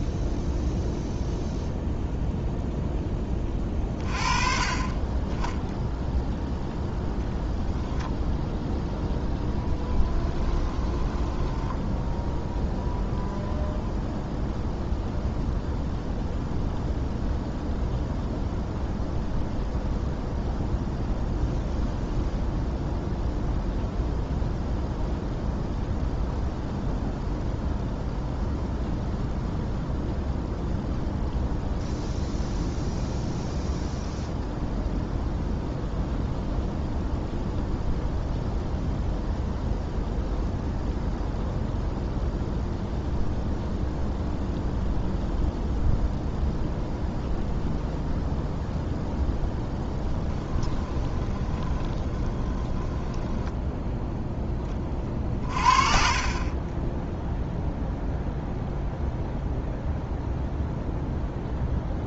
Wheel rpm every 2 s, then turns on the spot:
0, 0, 30, 0, 0, 20, 0, 0, 0, 0, 0, 0, 0, 0, 0, 0, 0, 0, 0, 0, 0, 0, 0, 0, 0, 10, 10, 20, 20, 0, 0.
10-12 50-54